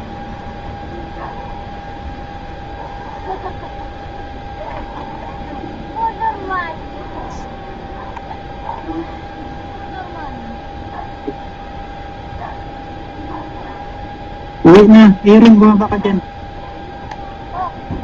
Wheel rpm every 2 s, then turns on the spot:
0, 0, 0, 0, 0, 0, 0, 0, 0.
none